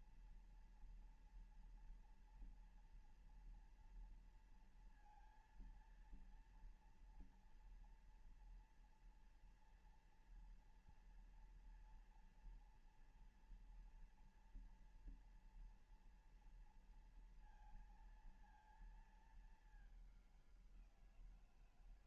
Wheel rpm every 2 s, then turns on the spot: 240, 230, 230, 230, 230, 240, 230, 230, 230, 230, 200.
none